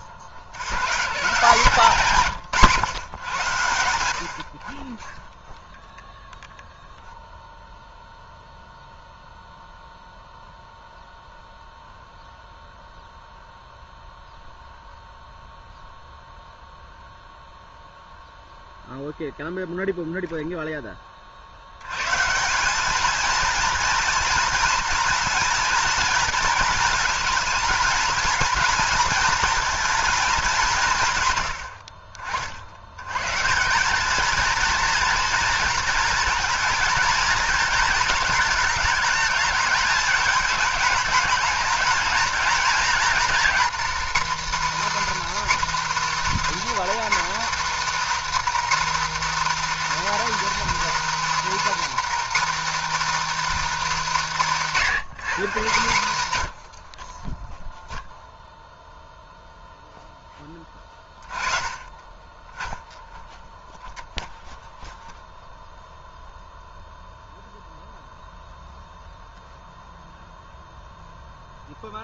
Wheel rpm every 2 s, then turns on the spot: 110, 140, 40, 0, 0, 0, 0, 0, 0, 0, 10, 200, 230, 230, 230, 200, 80, 230, 230, 220, 210, 230, 310, 320, 320, 330, 320, 240, 70, 0, 20, 10, 0, 0, 0, 0.
none